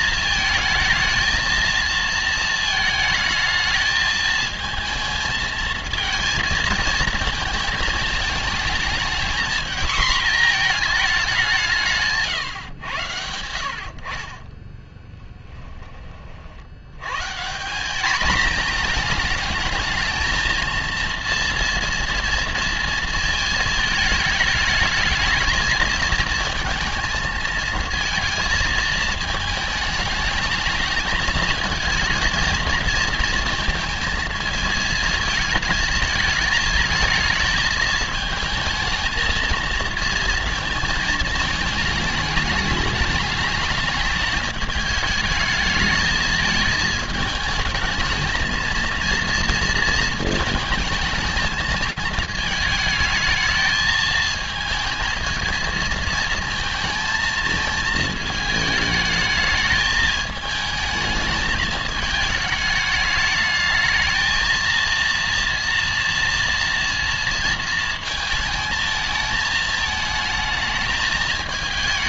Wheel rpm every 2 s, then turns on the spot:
220, 220, 220, 220, 220, 230, 130, 20, 70, 220, 230, 230, 220, 220, 230, 220, 230, 230, 220, 220, 230, 210, 210, 220, 220, 220, 220, 220, 230, 210, 220, 210, 230, 240, 220, 220.
14-16